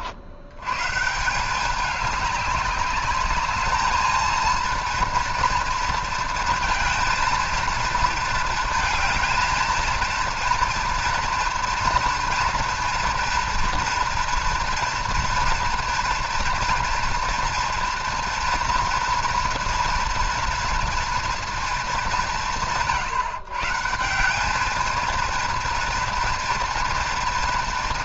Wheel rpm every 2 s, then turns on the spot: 120, 200, 230, 230, 220, 230, 240, 230, 240, 240, 230, 100, 210, 230.
none